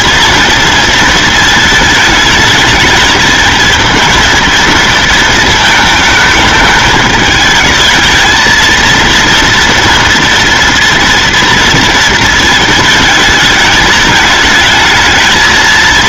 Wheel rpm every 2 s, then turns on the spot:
230, 220, 230, 220, 230, 230, 220, 220.
none